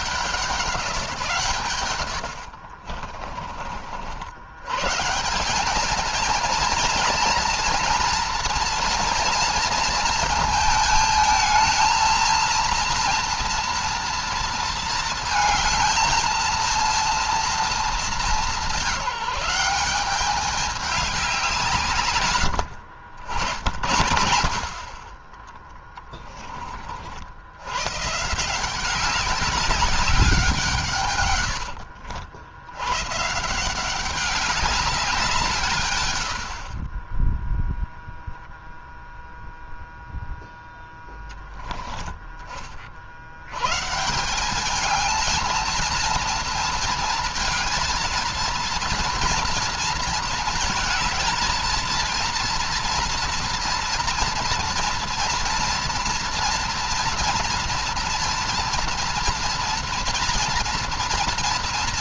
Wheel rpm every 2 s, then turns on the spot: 180, 50, 140, 230, 230, 220, 230, 230, 230, 200, 200, 90, 40, 50, 180, 140, 110, 190, 30, 0, 10, 50, 220, 230, 230, 220, 230, 230, 230, 230, 240.
2-4